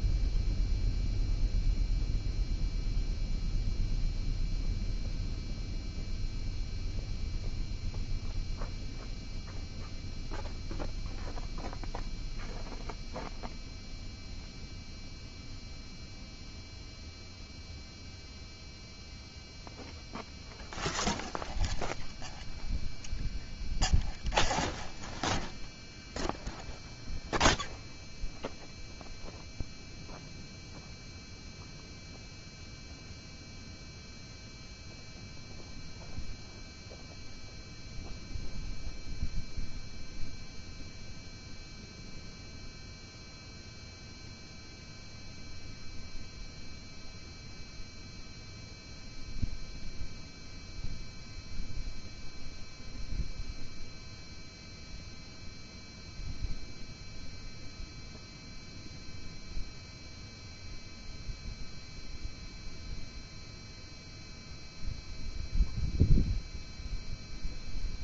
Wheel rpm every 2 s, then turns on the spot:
0, 0, 0, 0, 0, 0, 0, 0, 0, 0, 0, 0, 0, 0, 0, 0, 0, 0, 0, 0, 0, 0, 0, 0, 0, 0, 0, 0, 0, 0, 0, 0, 0, 0.
none